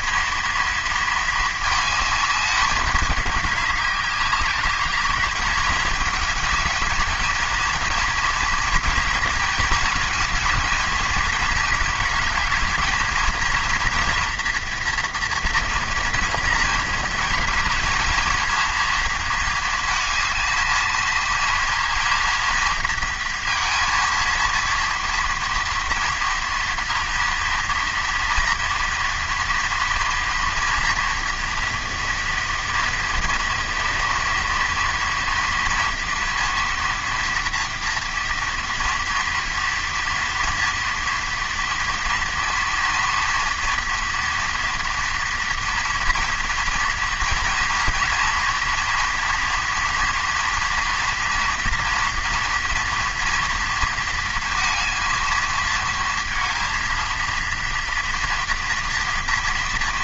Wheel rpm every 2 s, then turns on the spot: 230, 210, 210, 220, 230, 230, 220, 240, 230, 230, 220, 230, 230, 230, 230, 230, 230, 230, 230, 230, 230, 230, 230, 230, 240, 230, 230, 230, 230, 230.
none